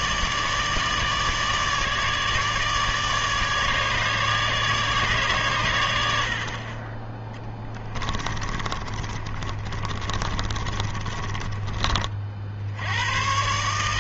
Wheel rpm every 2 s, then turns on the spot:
150, 150, 150, 30, 30, 30, 80.
8-12